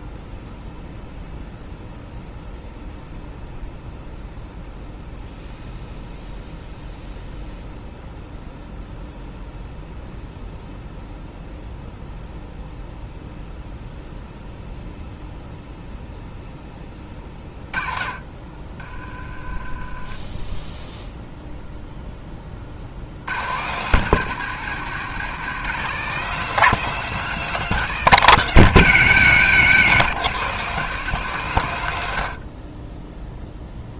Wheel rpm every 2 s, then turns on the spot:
0, 0, 0, 0, 0, 0, 0, 0, 10, 30, 10, 40, 170, 200, 170, 180, 40.
18-20